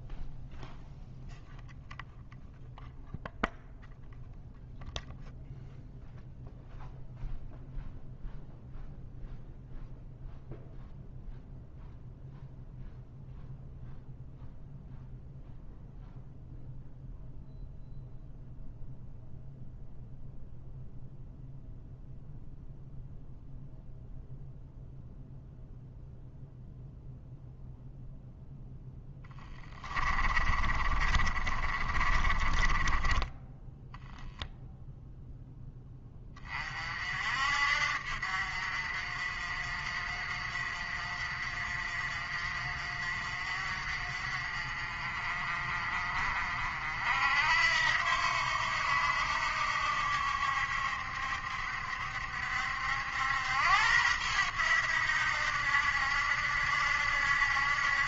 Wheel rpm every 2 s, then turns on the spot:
0, 0, 0, 0, 0, 0, 0, 0, 0, 0, 0, 0, 0, 0, 20, 30, 20, 0, 40, 50, 40, 40, 40, 60, 80, 70, 70, 90, 70.
28-34